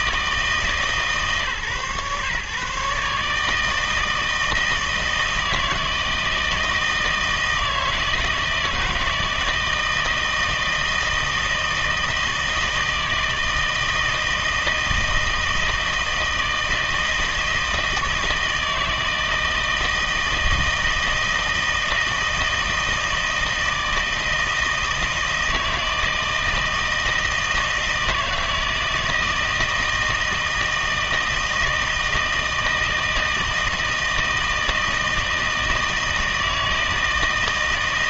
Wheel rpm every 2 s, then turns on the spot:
150, 140, 160, 160, 160, 160, 160, 160, 160, 160, 160, 160, 160, 160, 160, 160, 160, 160, 160.
none